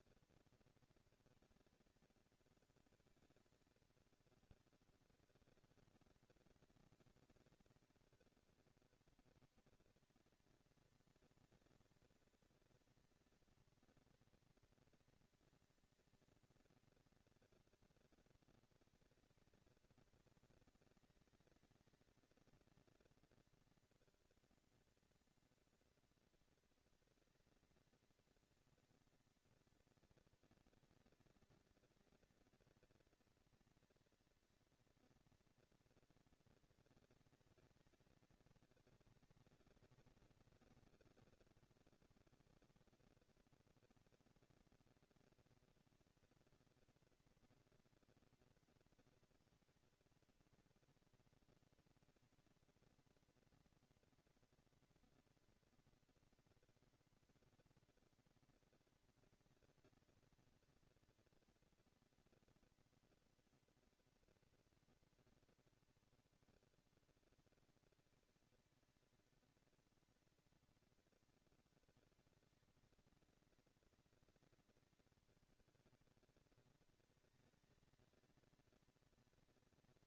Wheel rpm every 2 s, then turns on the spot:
230, 230, 210, 190, 210, 230, 230, 230, 230, 220, 230, 220, 230, 230, 230, 230, 240, 240, 230, 210, 200, 210, 230, 230, 230, 230, 230, 230, 230, 230, 230, 230, 230, 170, 220, 230, 200, 190, 210, 230.
none